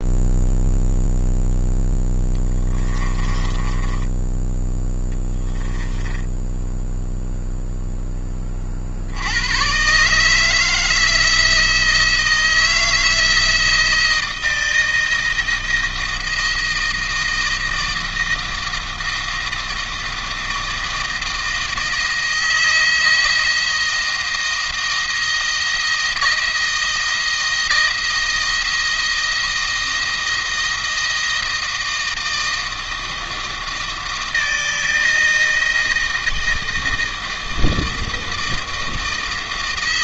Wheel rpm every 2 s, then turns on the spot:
0, 10, 10, 10, 50, 160, 160, 160, 160, 160, 160, 170, 170, 170, 170, 160, 160, 160, 160, 160.
2-4 6-8